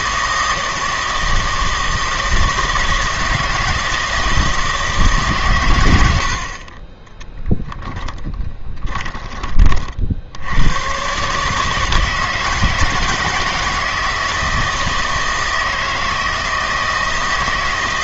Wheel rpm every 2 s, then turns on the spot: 160, 160, 160, 30, 20, 100, 160, 160, 160.
6-10